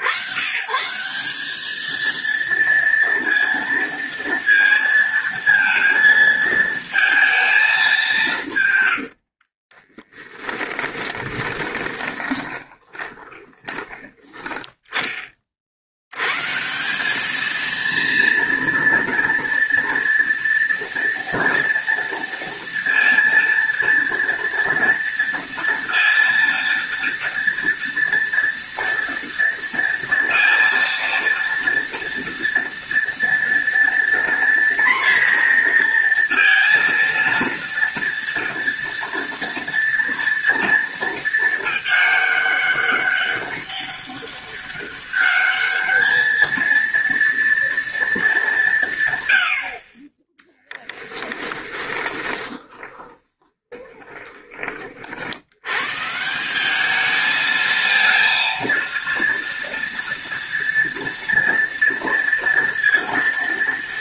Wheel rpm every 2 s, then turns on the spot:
160, 230, 230, 220, 90, 10, 20, 20, 190, 230, 230, 230, 230, 230, 230, 230, 230, 240, 230, 230, 230, 200, 200, 230, 140, 10, 20, 40, 210, 230, 230, 230.
8-14 50-54